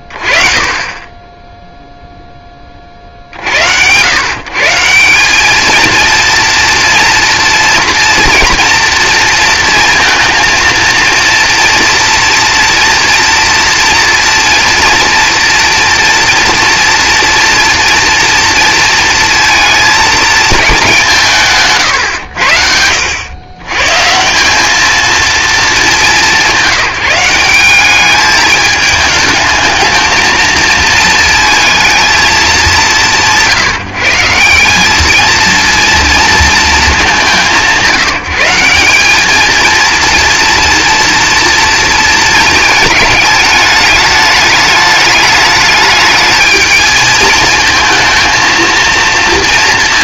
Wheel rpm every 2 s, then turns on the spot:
20, 20, 160, 230, 230, 230, 230, 230, 230, 230, 190, 80, 220, 190, 210, 220, 180, 200, 210, 190, 230, 220, 210, 220, 230.
none